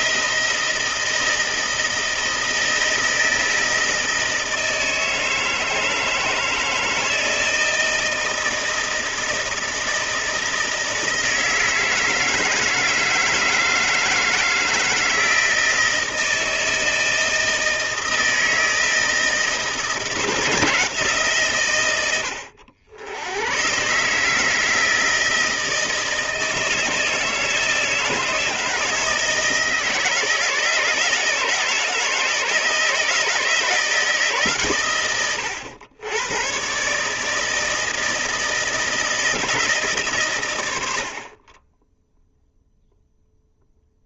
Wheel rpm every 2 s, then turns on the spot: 160, 160, 160, 160, 160, 160, 160, 160, 160, 160, 170, 80, 160, 160, 160, 160, 160, 130, 130, 160, 90, 0.
none